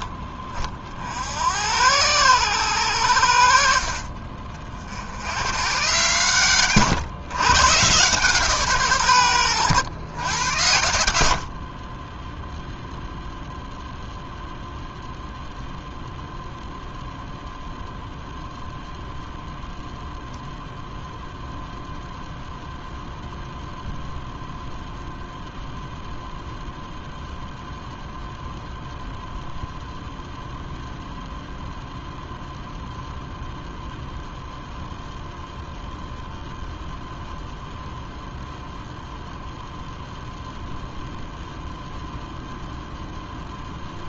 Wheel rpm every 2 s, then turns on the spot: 40, 100, 50, 120, 140, 90, 0, 0, 0, 0, 0, 0, 0, 0, 0, 0, 0, 0, 0, 0, 0, 0.
none